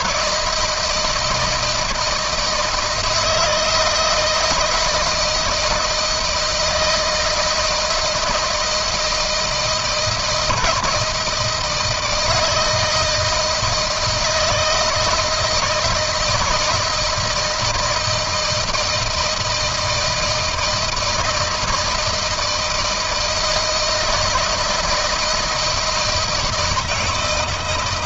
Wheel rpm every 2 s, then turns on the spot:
160, 160, 160, 160, 160, 170, 160, 160, 160, 160, 160, 160, 160, 160.
none